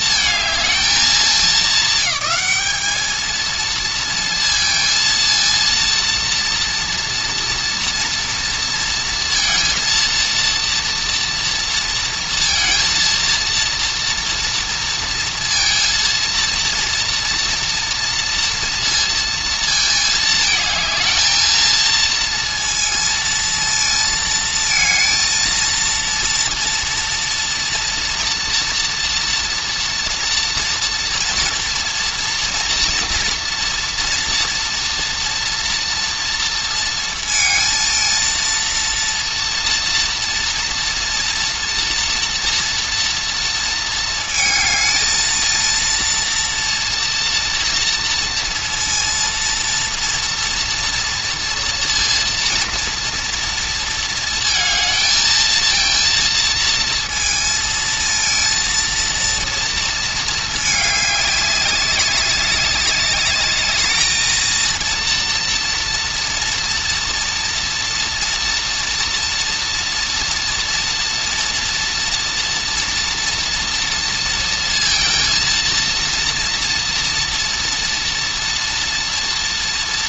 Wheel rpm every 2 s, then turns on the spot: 210, 200, 230, 230, 230, 230, 230, 230, 230, 230, 220, 230, 230, 230, 240, 230, 240, 230, 230, 230, 230, 230, 220, 230, 230, 240, 230, 220, 230, 230, 220, 200, 230, 230, 230, 230, 230, 230, 230, 230.
none